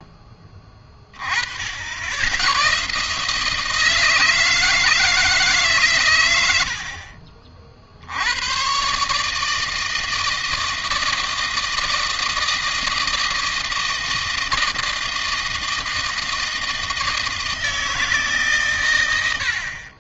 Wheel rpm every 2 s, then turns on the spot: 20, 130, 160, 60, 130, 160, 160, 160, 160, 120.
none